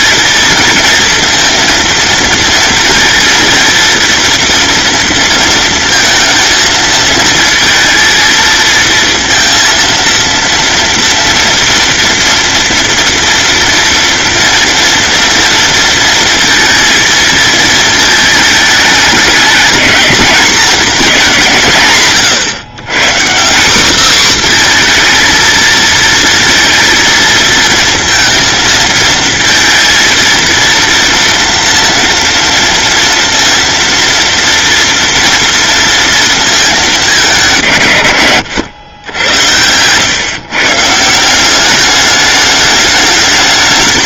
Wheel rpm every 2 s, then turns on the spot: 230, 230, 230, 230, 230, 230, 230, 230, 230, 210, 210, 130, 250, 230, 230, 230, 230, 230, 220, 110, 140, 210.
none